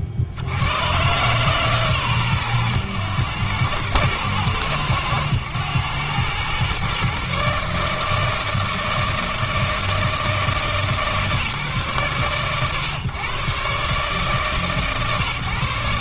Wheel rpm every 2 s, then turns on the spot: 80, 110, 110, 120, 160, 160, 120, 130.
none